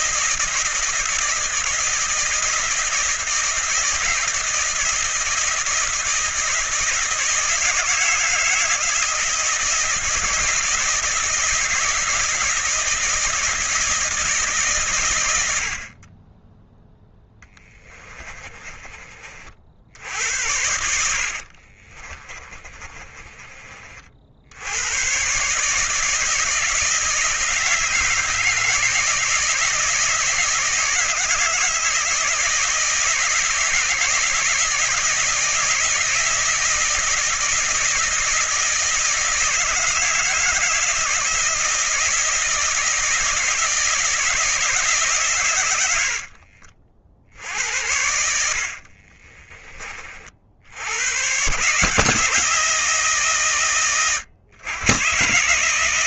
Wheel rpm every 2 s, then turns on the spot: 160, 160, 160, 160, 160, 160, 160, 130, 10, 30, 70, 30, 110, 160, 160, 160, 160, 160, 160, 160, 160, 160, 150, 50, 40, 80, 160, 130.
18-24 48-50